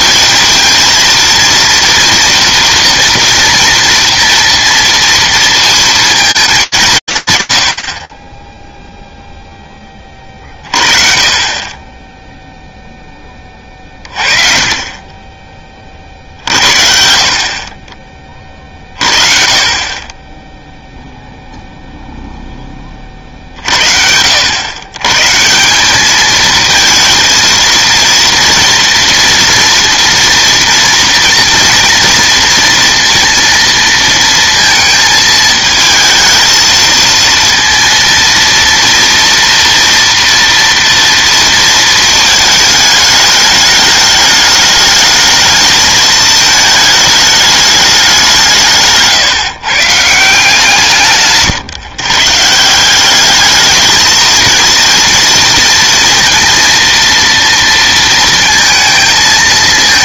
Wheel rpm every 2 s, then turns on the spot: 220, 230, 230, 200, 10, 30, 0, 30, 70, 30, 0, 10, 90, 220, 230, 230, 230, 230, 220, 230, 230, 220, 210, 220, 150, 160, 170, 230, 230, 220.
none